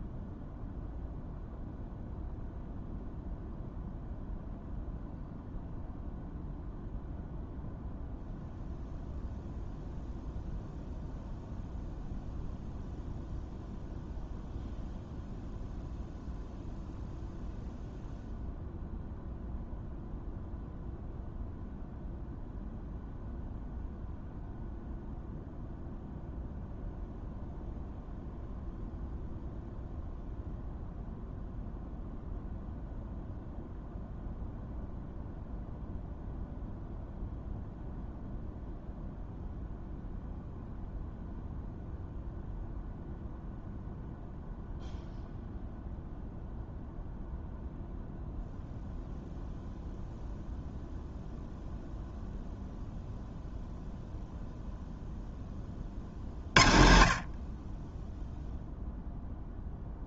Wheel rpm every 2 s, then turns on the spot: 0, 0, 0, 0, 0, 0, 0, 0, 0, 0, 0, 0, 0, 0, 0, 0, 0, 0, 0, 0, 0, 0, 0, 0, 0, 0, 0, 0, 40, 0.
none